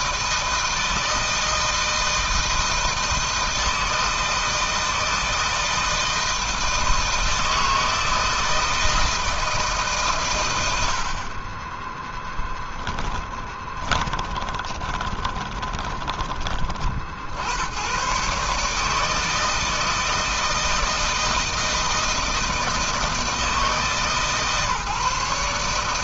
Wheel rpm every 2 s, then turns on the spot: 160, 160, 160, 160, 160, 120, 20, 20, 30, 130, 160, 160, 150.
12-16